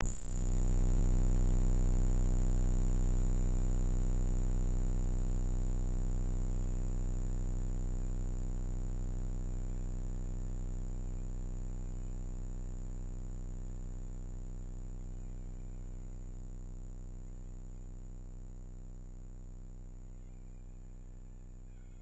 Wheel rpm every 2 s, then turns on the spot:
20, 190, 230, 230, 230, 220, 230, 120, 80, 130, 210.
none